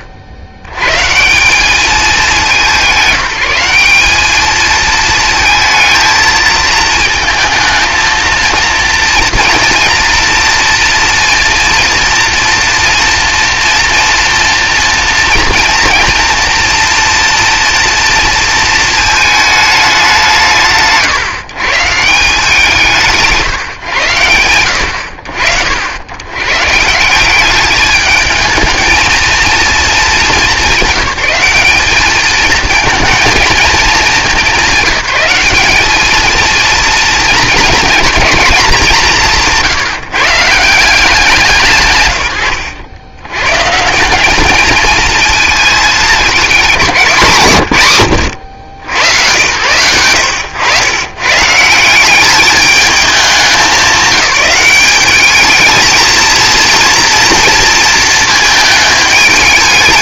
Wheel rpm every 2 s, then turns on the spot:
90, 180, 220, 220, 230, 230, 240, 230, 240, 220, 110, 150, 60, 170, 220, 190, 220, 190, 220, 200, 170, 110, 220, 190, 80, 100, 210, 190, 230, 210.
none